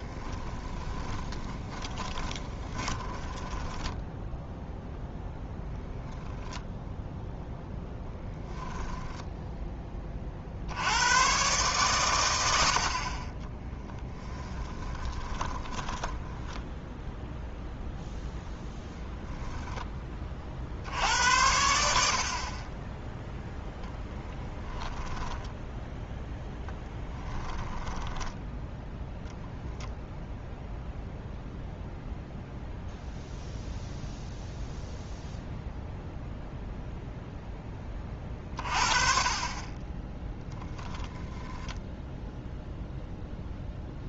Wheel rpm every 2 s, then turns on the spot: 20, 20, 0, 0, 10, 70, 80, 20, 10, 0, 60, 30, 10, 10, 10, 0, 0, 0, 0, 40, 10, 0.
0-4 14-16 24-26 28-30